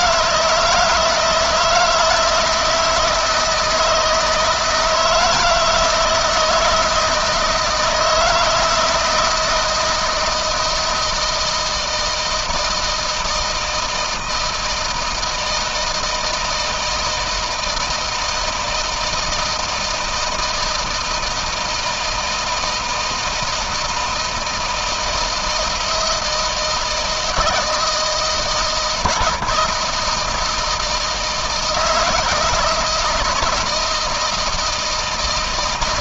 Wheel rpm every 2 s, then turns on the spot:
160, 160, 160, 160, 160, 160, 160, 160, 160, 160, 160, 170, 160, 160, 160, 160, 160, 160.
none